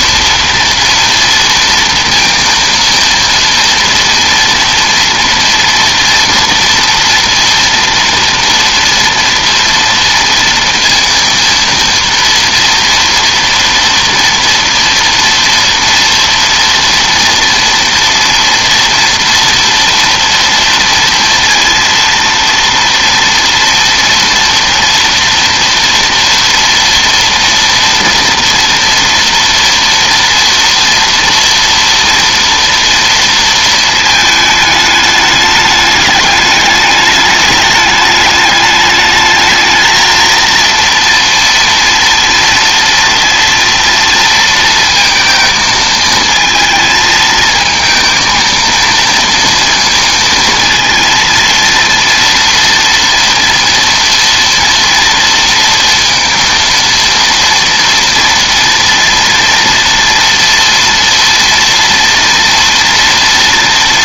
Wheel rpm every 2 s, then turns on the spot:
230, 230, 230, 230, 240, 230, 230, 230, 230, 230, 230, 230, 230, 230, 230, 230, 230, 220, 210, 210, 230, 230, 230, 220, 230, 230, 230, 230, 230, 230, 230, 230.
none